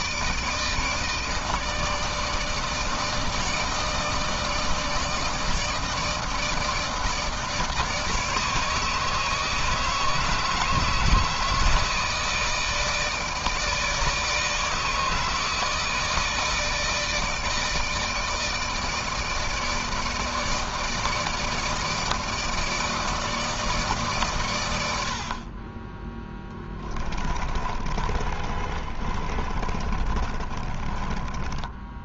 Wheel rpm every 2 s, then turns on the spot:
160, 160, 160, 160, 150, 160, 160, 160, 160, 160, 160, 160, 110, 10, 40, 30.
26-32